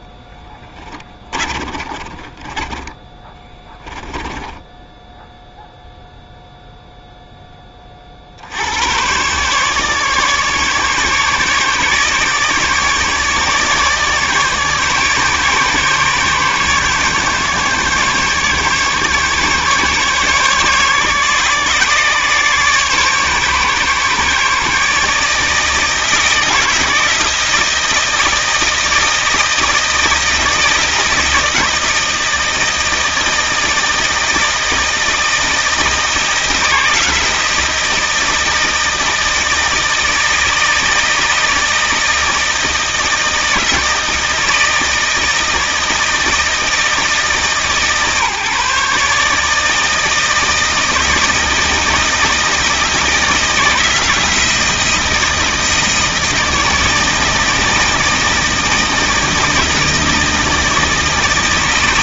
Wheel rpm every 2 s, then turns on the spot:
20, 30, 10, 0, 100, 150, 150, 150, 150, 140, 140, 140, 150, 160, 170, 160, 160, 160, 170, 160, 160, 160, 160, 160, 150, 160, 160, 170, 160, 160, 160.
0-6